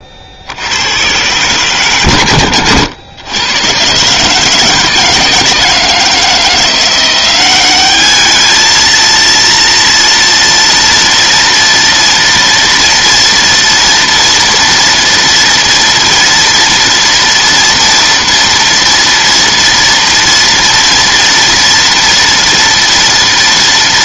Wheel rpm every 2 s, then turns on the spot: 70, 100, 140, 160, 220, 240, 230, 230, 230, 230, 230, 230.
none